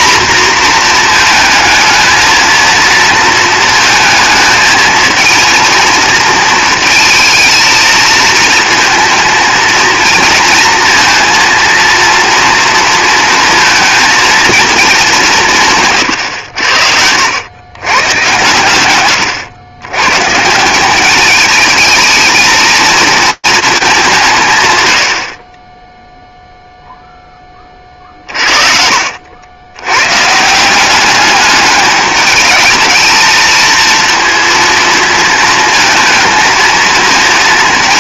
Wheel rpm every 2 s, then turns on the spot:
230, 230, 220, 220, 230, 230, 230, 210, 70, 120, 180, 230, 110, 0, 60, 190, 210, 230, 220.
16-18